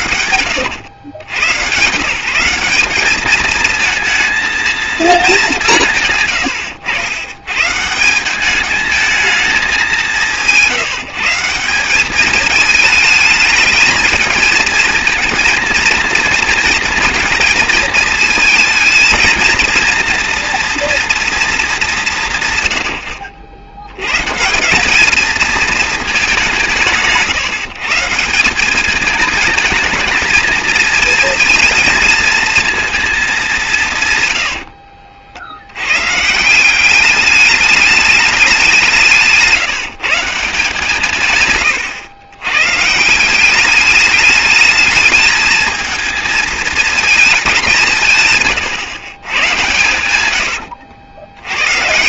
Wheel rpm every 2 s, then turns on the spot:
90, 200, 230, 100, 220, 170, 220, 230, 230, 220, 230, 110, 200, 160, 200, 220, 220, 60, 190, 170, 160, 150, 210, 220, 130, 60.
34-36 50-52